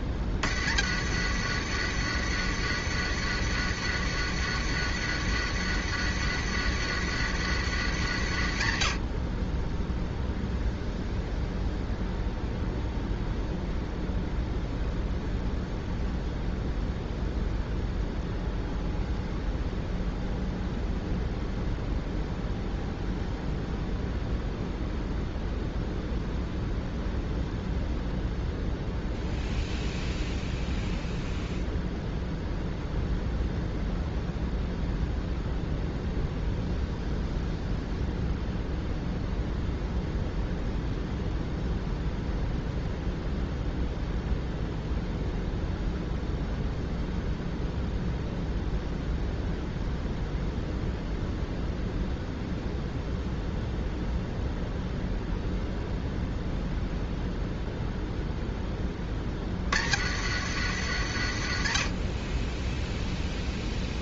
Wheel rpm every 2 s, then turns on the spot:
70, 100, 100, 100, 60, 0, 0, 0, 0, 0, 0, 0, 0, 0, 0, 0, 0, 0, 0, 0, 0, 0, 0, 0, 0, 0, 0, 0, 0, 10, 90, 10.
none